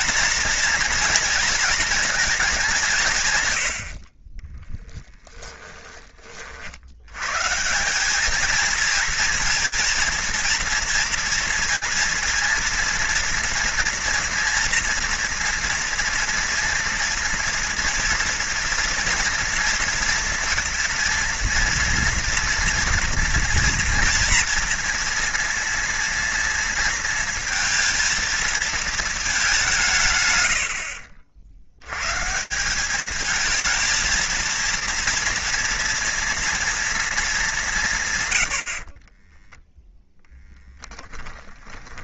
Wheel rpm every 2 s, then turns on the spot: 230, 190, 10, 70, 230, 230, 230, 230, 230, 240, 240, 230, 230, 230, 220, 70, 190, 230, 230, 40, 10.
4-6 38-42